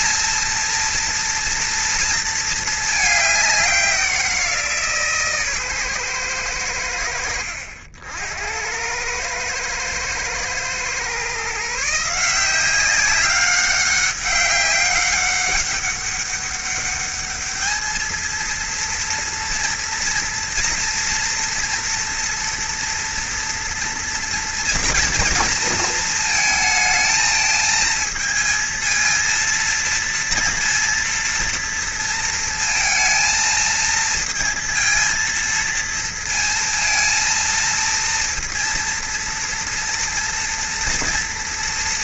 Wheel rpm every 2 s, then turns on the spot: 230, 210, 160, 80, 100, 120, 190, 200, 210, 230, 230, 230, 230, 220, 230, 230, 220, 230, 230, 240, 230.
none